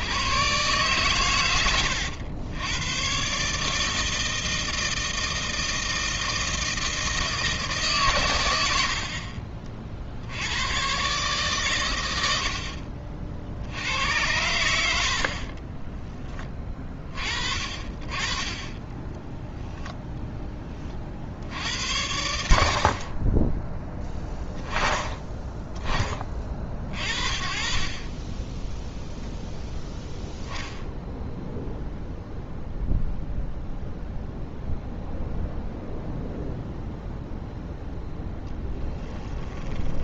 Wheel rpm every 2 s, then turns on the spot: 130, 100, 160, 160, 90, 100, 60, 80, 20, 20, 20, 60, 10, 40, 10, 0, 0, 0, 0, 10.
38-40